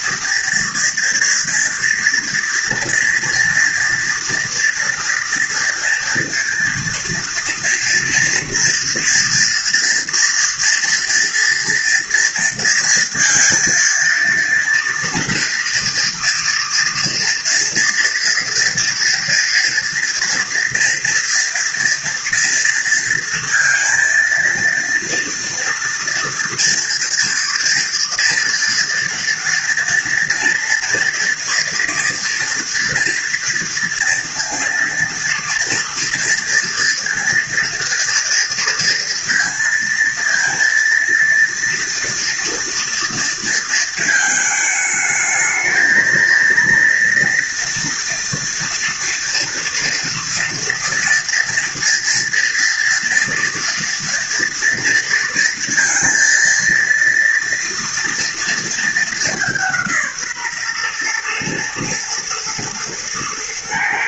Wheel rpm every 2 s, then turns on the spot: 230, 230, 230, 230, 230, 230, 230, 230, 230, 230, 240, 240, 230, 230, 240, 230, 230, 230, 230, 230, 230, 230, 220, 230, 230, 240, 230, 230, 230, 230, 140, 120.
none